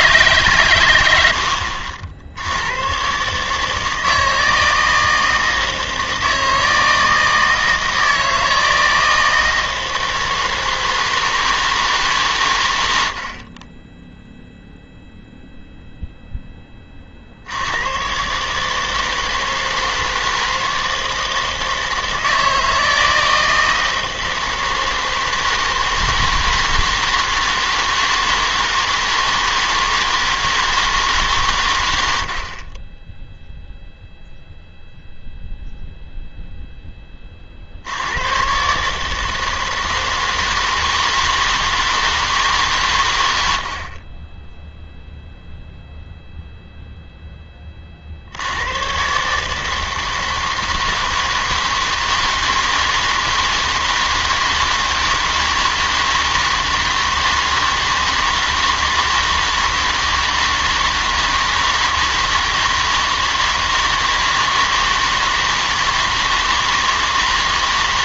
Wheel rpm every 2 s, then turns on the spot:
120, 100, 160, 160, 160, 160, 100, 0, 10, 150, 160, 160, 160, 160, 160, 160, 30, 0, 0, 130, 160, 150, 10, 0, 90, 160, 160, 160, 160, 160, 160, 160, 160, 160.
none